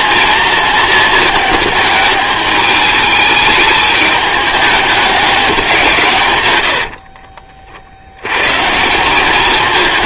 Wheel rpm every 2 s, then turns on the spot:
230, 210, 210, 70, 150.
6-8